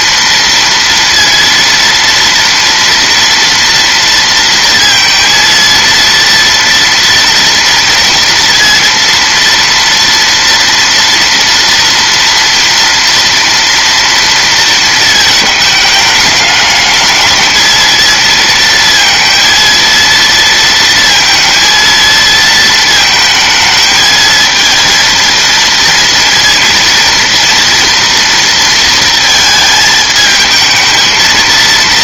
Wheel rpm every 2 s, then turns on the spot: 230, 240, 230, 230, 230, 230, 230, 220, 220, 230, 230, 220, 230, 230, 230, 220.
none